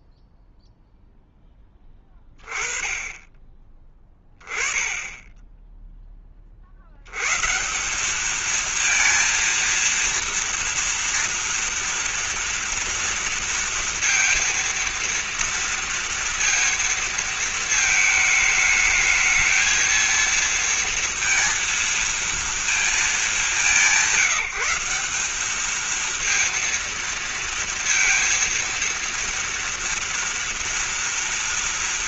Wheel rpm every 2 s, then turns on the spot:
0, 20, 10, 50, 230, 230, 230, 230, 230, 210, 230, 230, 180, 230, 230, 230.
none